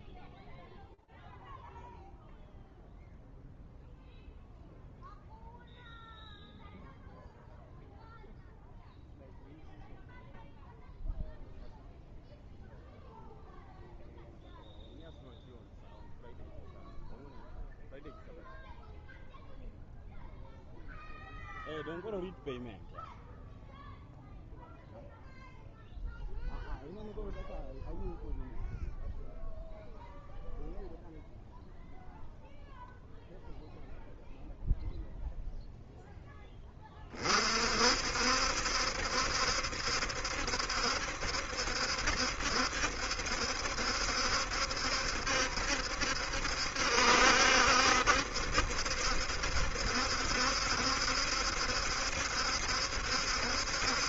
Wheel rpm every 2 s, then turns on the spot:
0, 0, 0, 0, 0, 0, 0, 0, 0, 0, 0, 0, 0, 0, 0, 0, 0, 0, 10, 60, 70, 70, 70, 70, 70, 70, 70.
none